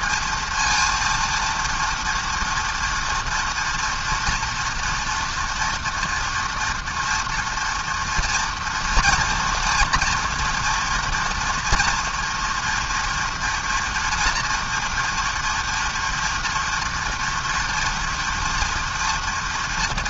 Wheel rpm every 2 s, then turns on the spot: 230, 230, 240, 240, 230, 230, 230, 240, 230, 230.
none